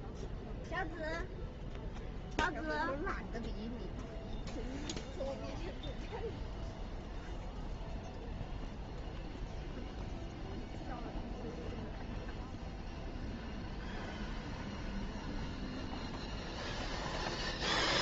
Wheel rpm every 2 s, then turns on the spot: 0, 0, 0, 0, 0, 0, 0, 0, 0.
none